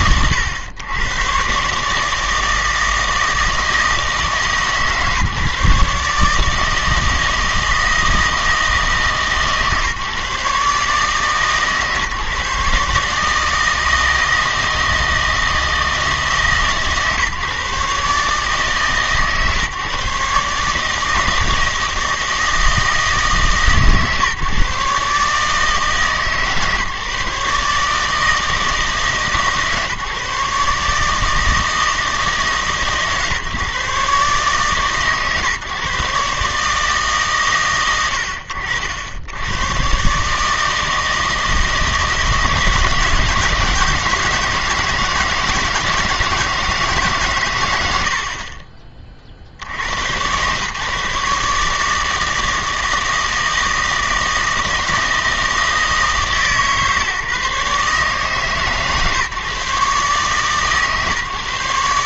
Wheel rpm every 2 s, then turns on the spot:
110, 160, 150, 160, 160, 140, 150, 160, 140, 140, 140, 160, 140, 140, 160, 150, 140, 140, 150, 80, 150, 160, 160, 160, 30, 130, 160, 160, 150, 140, 140.
48-50